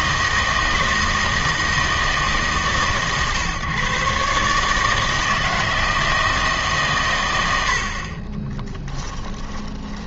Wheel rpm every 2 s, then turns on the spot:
160, 150, 150, 140, 10.
8-10